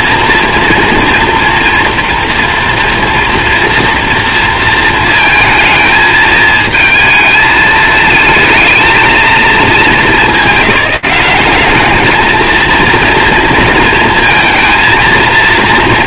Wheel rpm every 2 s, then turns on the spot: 230, 240, 230, 220, 220, 210, 220, 230.
none